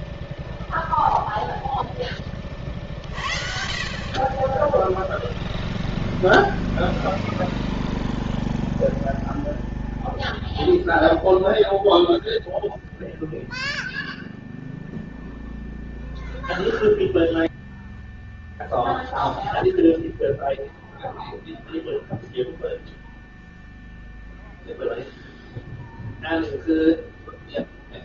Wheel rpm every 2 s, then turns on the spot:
0, 40, 10, 0, 0, 0, 0, 0, 0, 0, 0, 0, 0, 0.
none